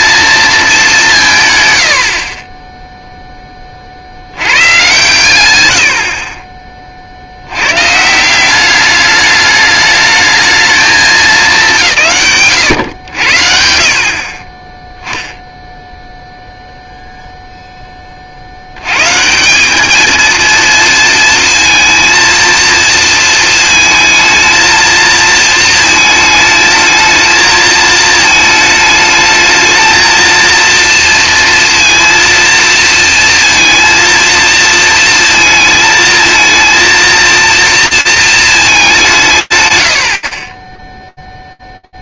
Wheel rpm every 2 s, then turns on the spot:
200, 10, 120, 40, 200, 220, 120, 10, 0, 80, 230, 230, 220, 220, 220, 230, 230, 230, 230, 200, 10.
none